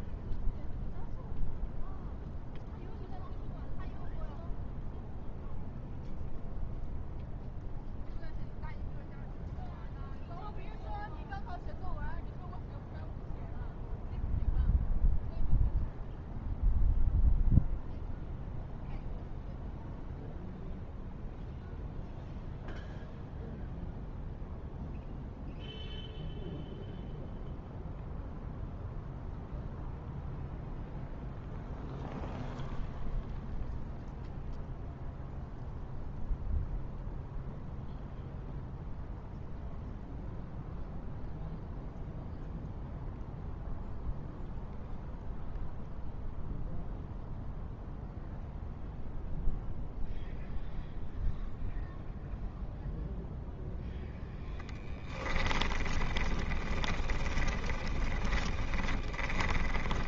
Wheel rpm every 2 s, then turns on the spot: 0, 0, 0, 0, 0, 0, 0, 0, 0, 0, 0, 0, 0, 0, 0, 0, 0, 0, 0, 0, 0, 0, 0, 0, 0, 0, 0, 10, 20, 20.
54-60